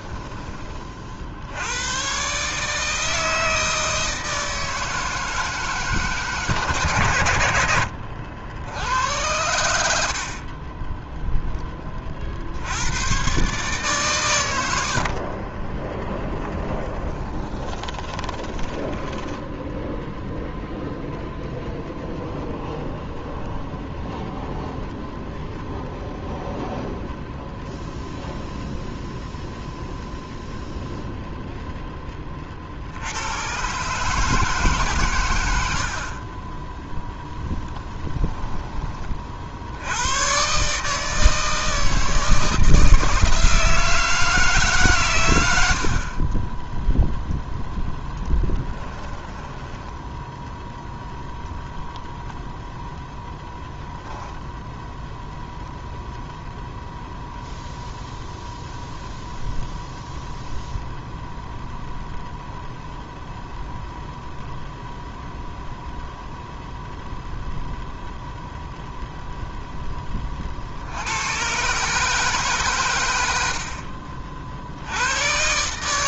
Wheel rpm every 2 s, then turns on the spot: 40, 160, 160, 130, 90, 20, 90, 90, 20, 20, 0, 0, 0, 0, 0, 0, 60, 140, 0, 20, 150, 160, 140, 10, 10, 0, 0, 0, 0, 0, 0, 0, 0, 0, 0, 60, 120, 80.
16-20 48-50